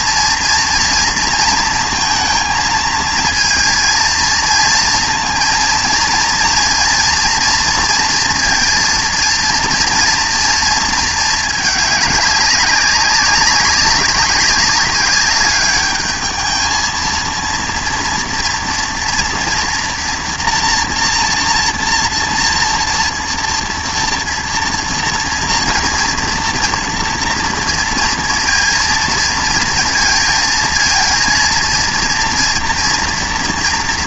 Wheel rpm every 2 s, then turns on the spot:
230, 220, 230, 240, 230, 230, 200, 200, 220, 230, 230, 230, 230, 230, 230, 220, 230.
none